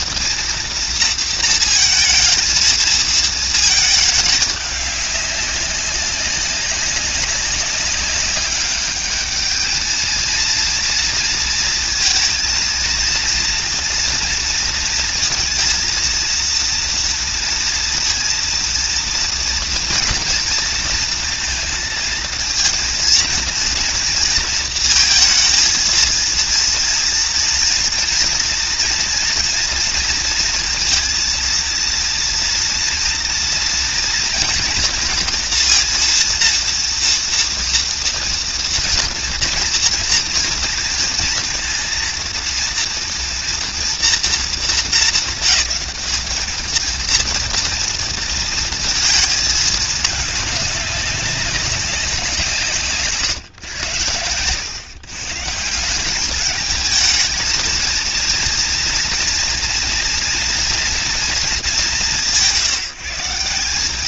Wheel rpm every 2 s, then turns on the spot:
230, 220, 200, 190, 200, 230, 230, 230, 230, 230, 230, 230, 230, 230, 230, 230, 230, 230, 230, 230, 230, 230, 230, 220, 230, 200, 150, 120, 210, 230, 230, 180.
none